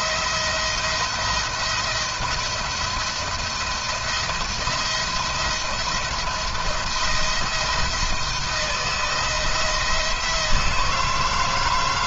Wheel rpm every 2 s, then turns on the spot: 170, 170, 160, 160, 170, 160.
none